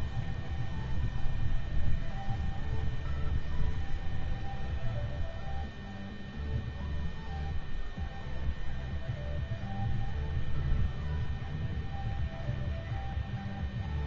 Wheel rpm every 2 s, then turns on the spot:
0, 0, 0, 0, 0, 0, 0.
none